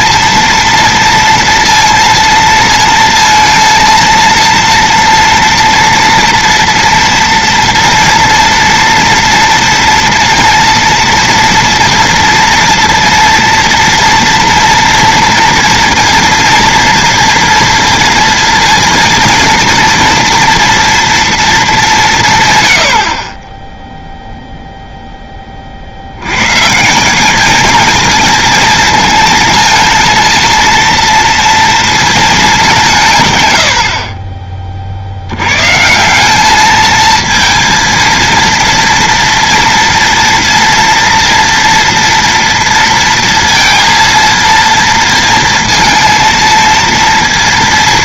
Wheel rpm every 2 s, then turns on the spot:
230, 230, 230, 230, 240, 230, 230, 240, 230, 230, 230, 110, 0, 150, 230, 230, 190, 40, 220, 230, 230, 230, 230, 230.
none